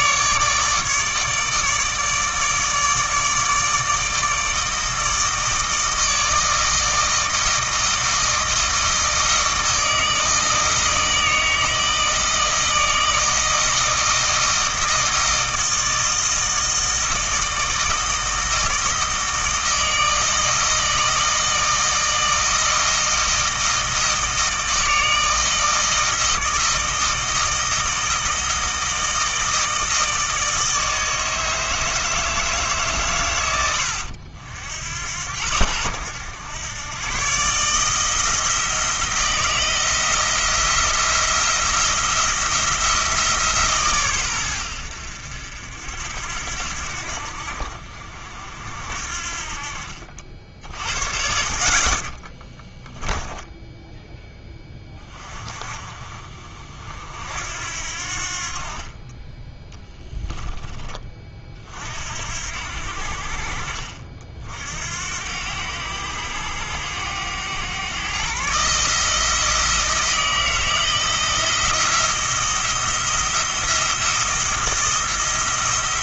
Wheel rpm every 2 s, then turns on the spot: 150, 150, 160, 160, 160, 160, 160, 160, 160, 160, 160, 160, 160, 160, 160, 160, 140, 70, 110, 160, 170, 160, 80, 70, 60, 50, 10, 20, 50, 40, 20, 70, 70, 100, 150, 160, 170, 170.
52-54